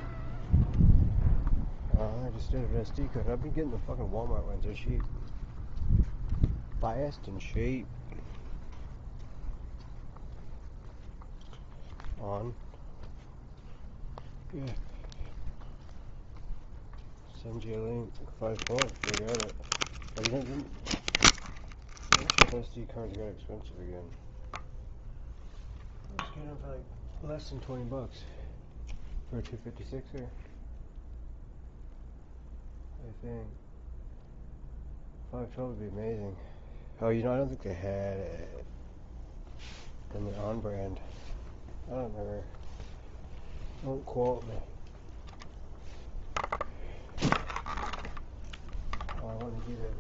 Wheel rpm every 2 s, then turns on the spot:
0, 0, 0, 0, 0, 0, 0, 0, 0, 0, 0, 0, 0, 0, 0, 0, 0, 0, 0, 0, 0, 0, 0, 0, 0.
none